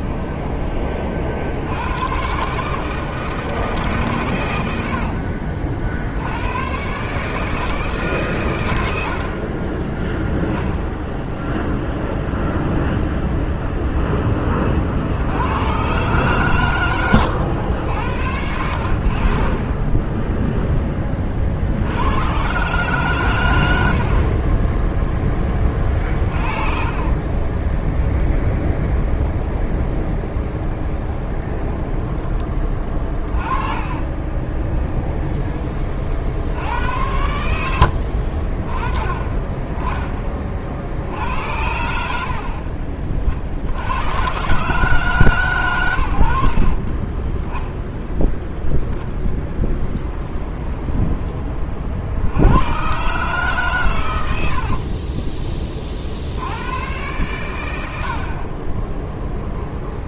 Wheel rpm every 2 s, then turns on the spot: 10, 150, 90, 120, 100, 0, 0, 30, 120, 80, 0, 130, 20, 40, 0, 10, 20, 20, 80, 40, 50, 40, 140, 50, 0, 10, 100, 60, 100, 30.
24-28 30-36 50-52 54-56